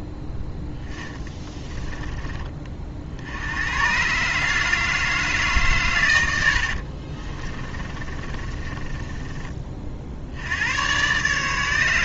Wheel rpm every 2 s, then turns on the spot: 0, 40, 150, 80, 20, 100.
6-10